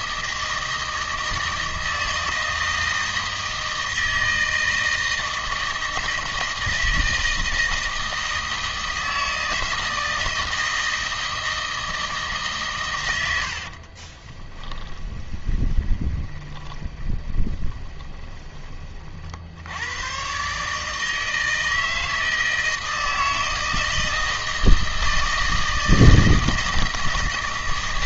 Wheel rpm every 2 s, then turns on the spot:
160, 160, 160, 160, 160, 160, 140, 20, 20, 20, 140, 160, 160, 160.
14-18